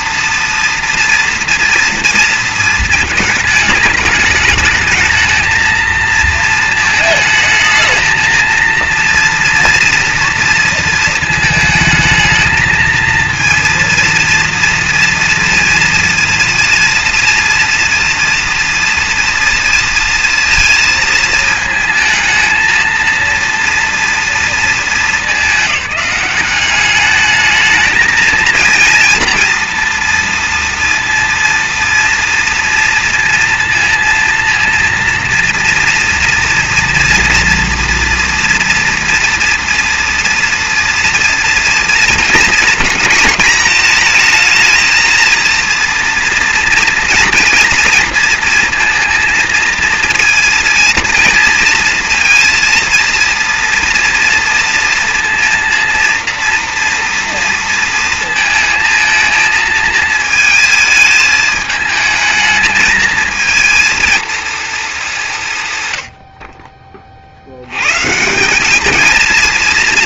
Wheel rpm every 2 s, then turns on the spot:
240, 220, 210, 220, 230, 230, 220, 230, 230, 230, 230, 220, 230, 200, 230, 230, 230, 230, 230, 230, 230, 220, 220, 230, 230, 230, 230, 230, 230, 220, 220, 220, 230, 40, 190.
none